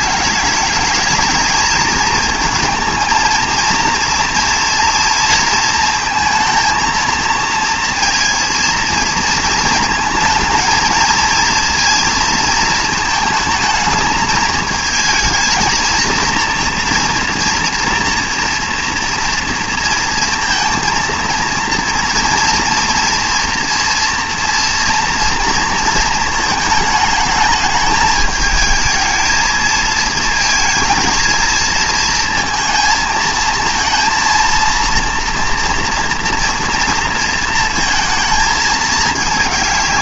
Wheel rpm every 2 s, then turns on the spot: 210, 230, 230, 230, 230, 230, 220, 220, 230, 230, 230, 230, 230, 220, 220, 230, 230, 230, 230, 230.
none